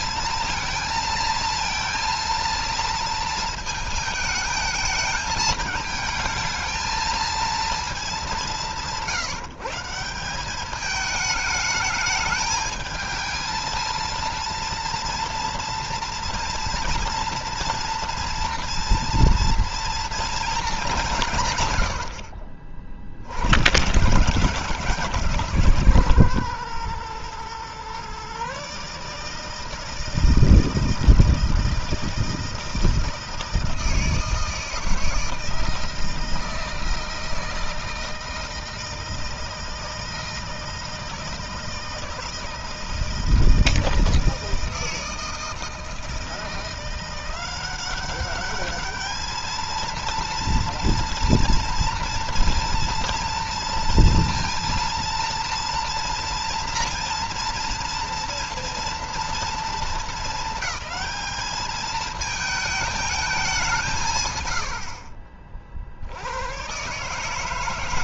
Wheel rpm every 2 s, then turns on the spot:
230, 230, 220, 220, 180, 200, 220, 230, 230, 230, 210, 60, 190, 130, 140, 160, 160, 160, 160, 160, 160, 160, 160, 170, 210, 230, 230, 230, 230, 230, 220, 220, 70, 130.
none